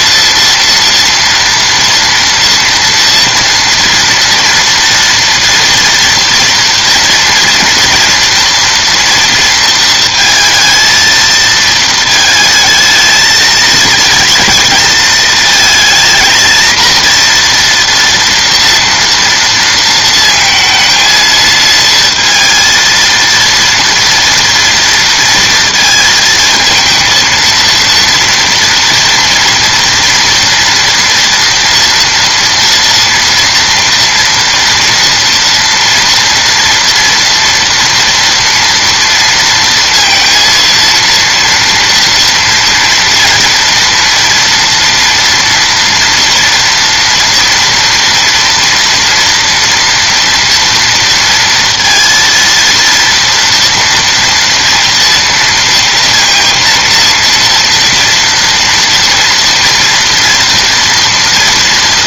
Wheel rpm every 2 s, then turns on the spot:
230, 230, 230, 230, 230, 230, 220, 220, 230, 230, 230, 230, 240, 220, 230, 230, 230, 230, 230, 240, 230, 230, 230, 230, 230, 230, 230, 230, 230, 240, 230.
none